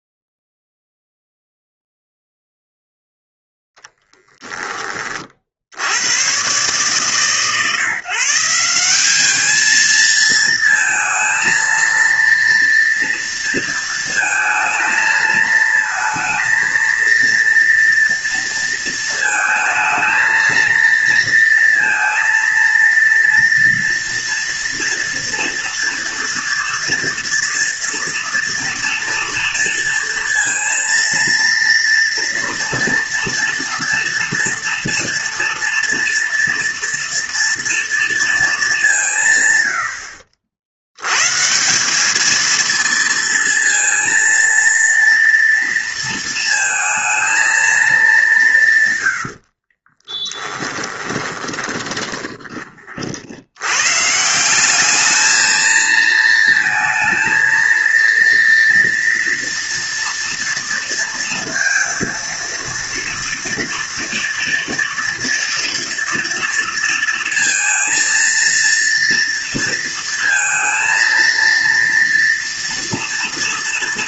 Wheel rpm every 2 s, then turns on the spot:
0, 0, 30, 130, 190, 230, 230, 220, 230, 230, 230, 230, 230, 230, 230, 230, 230, 230, 230, 180, 110, 230, 230, 230, 120, 20, 50, 210, 220, 230, 230, 230, 230, 230, 230, 230, 230.
50-52